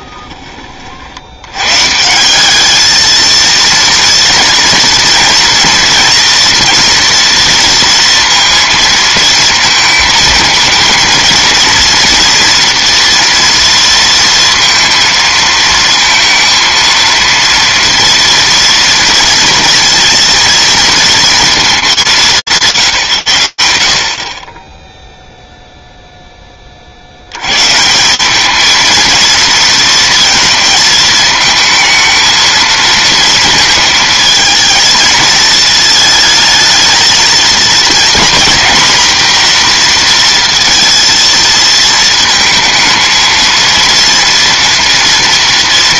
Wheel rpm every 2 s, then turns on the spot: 20, 200, 230, 230, 230, 230, 230, 230, 230, 230, 230, 170, 10, 40, 220, 220, 230, 220, 220, 250, 230, 220, 230.
none